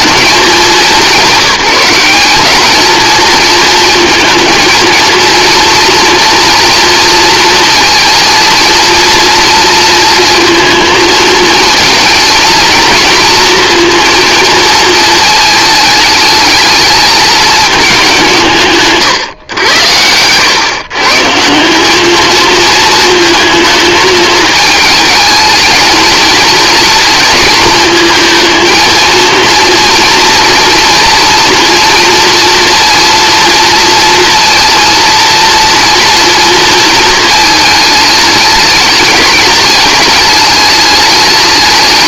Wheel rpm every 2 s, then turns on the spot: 200, 220, 230, 230, 230, 230, 230, 230, 220, 160, 130, 220, 210, 230, 230, 230, 230, 230, 230, 210, 210.
none